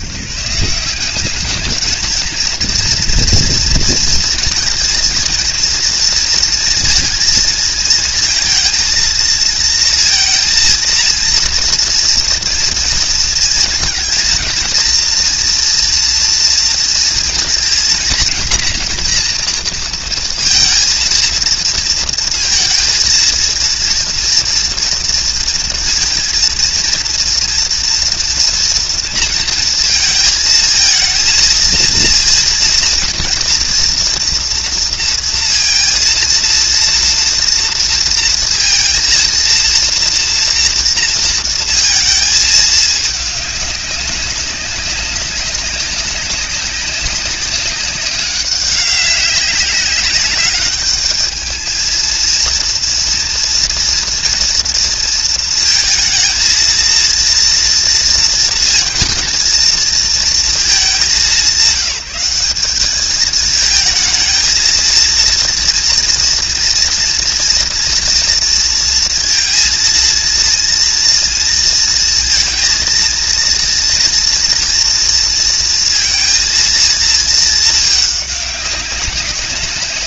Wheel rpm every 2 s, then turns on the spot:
150, 230, 230, 230, 230, 230, 230, 230, 230, 230, 230, 230, 240, 230, 230, 220, 230, 240, 230, 230, 230, 220, 190, 200, 200, 200, 230, 230, 230, 230, 210, 200, 220, 230, 230, 230, 230, 240, 230, 200.
none